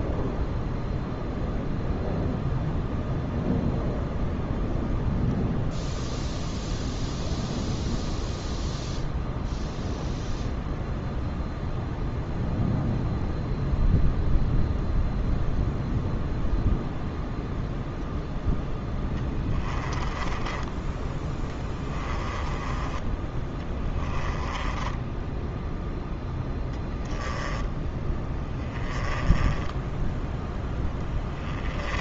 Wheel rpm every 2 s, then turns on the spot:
0, 0, 0, 0, 0, 0, 0, 0, 0, 10, 10, 20, 10, 10, 10, 10.
18-32